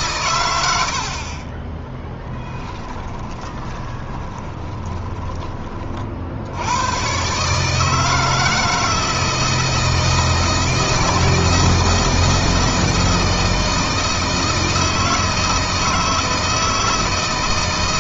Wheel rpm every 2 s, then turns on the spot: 90, 10, 20, 90, 160, 160, 160, 160, 160.
0-6